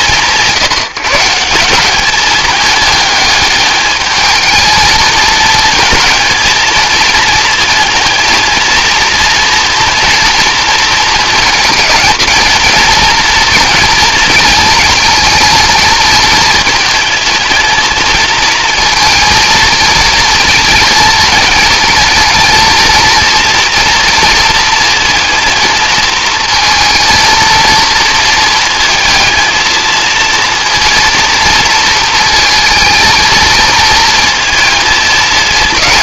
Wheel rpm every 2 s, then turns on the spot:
170, 210, 220, 220, 220, 230, 230, 230, 220, 230, 230, 230, 230, 230, 220, 230, 230, 230.
none